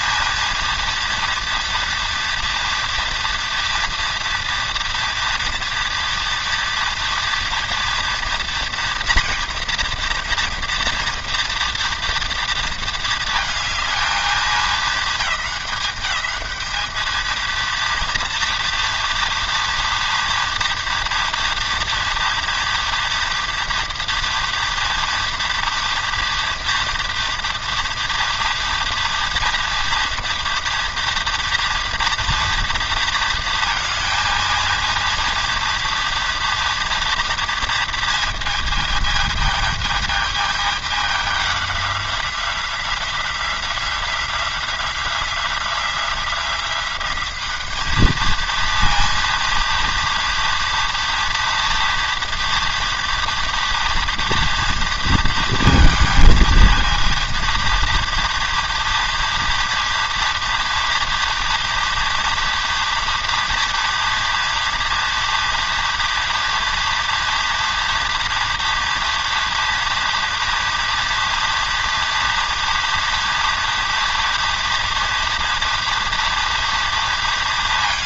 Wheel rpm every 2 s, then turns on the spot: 230, 230, 230, 230, 230, 240, 230, 220, 210, 230, 230, 230, 230, 230, 230, 230, 230, 230, 230, 220, 210, 180, 180, 180, 230, 230, 240, 230, 230, 230, 230, 230, 230, 230, 230, 230, 230, 230, 230.
none